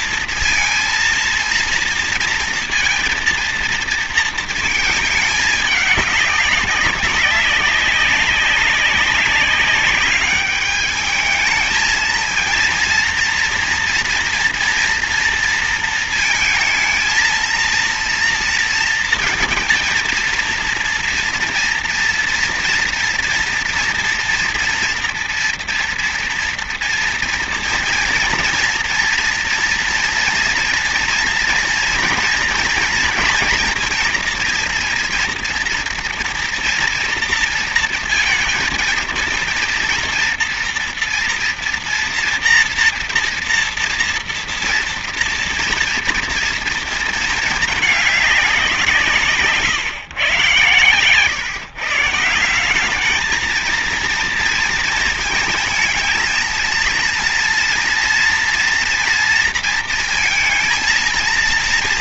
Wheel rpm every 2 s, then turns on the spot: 230, 230, 230, 200, 200, 200, 230, 230, 220, 230, 230, 230, 230, 230, 230, 230, 230, 230, 240, 230, 230, 240, 230, 230, 200, 120, 170, 230, 230, 230, 230.
none